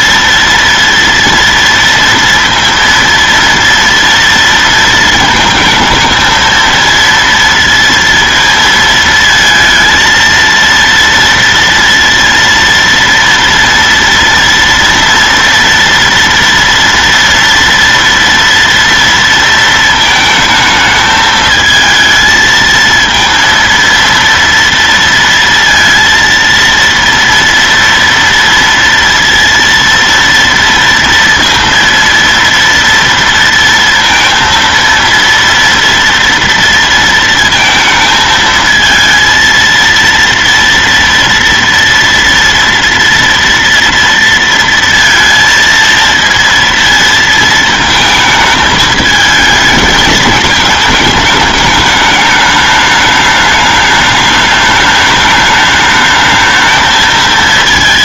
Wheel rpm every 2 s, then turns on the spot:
230, 230, 230, 220, 230, 230, 230, 230, 230, 230, 220, 220, 230, 230, 230, 230, 230, 230, 230, 220, 230, 230, 230, 230, 220, 220, 210, 210, 220.
none